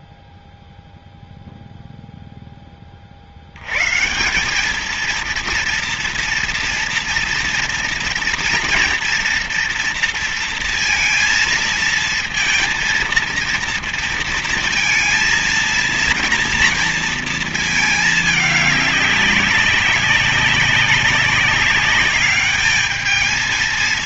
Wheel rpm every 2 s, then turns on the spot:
0, 30, 200, 230, 230, 230, 230, 230, 230, 200, 190, 210.
none